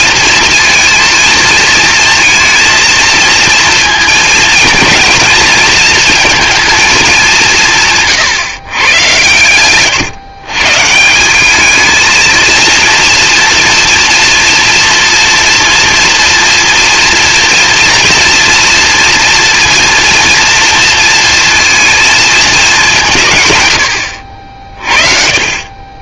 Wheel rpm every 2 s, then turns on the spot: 230, 230, 230, 220, 120, 150, 230, 230, 230, 230, 230, 190, 40.
none